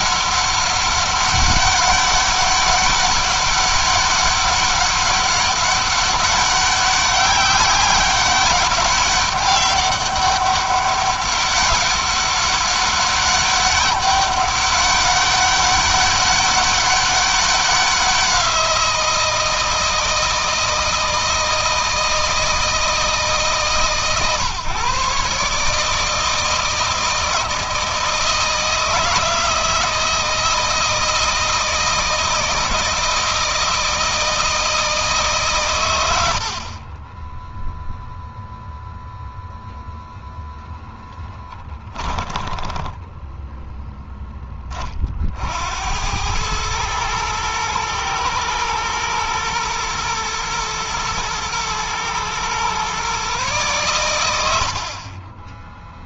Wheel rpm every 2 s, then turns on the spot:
200, 200, 200, 190, 200, 200, 200, 200, 200, 170, 160, 160, 130, 160, 170, 160, 160, 150, 30, 0, 0, 10, 30, 110, 120, 110, 130, 40.
36-38 42-44